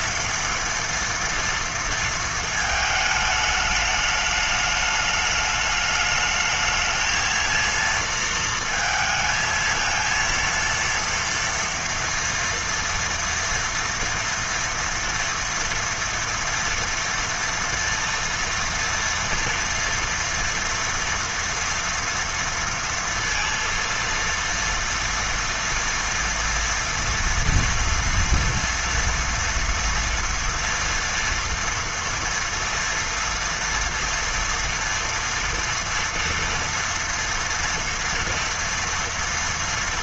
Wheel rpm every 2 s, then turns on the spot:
230, 220, 210, 220, 230, 230, 230, 230, 230, 230, 230, 230, 230, 230, 230, 230, 230, 230, 230, 230.
none